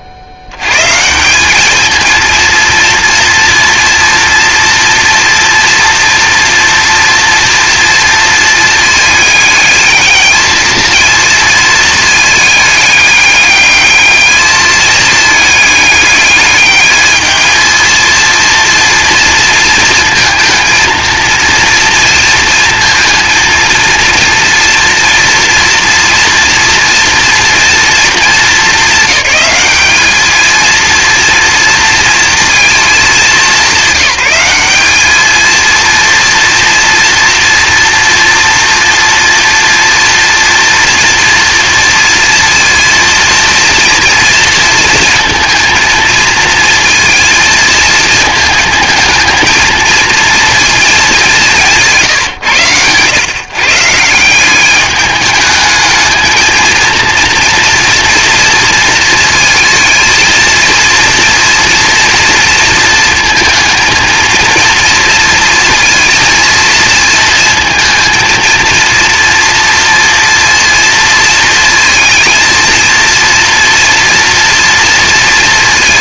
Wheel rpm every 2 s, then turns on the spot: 80, 230, 240, 230, 220, 220, 210, 220, 210, 230, 230, 230, 230, 230, 210, 230, 220, 200, 230, 230, 230, 230, 230, 230, 220, 230, 110, 200, 230, 230, 230, 230, 230, 230, 230, 230, 230, 230.
none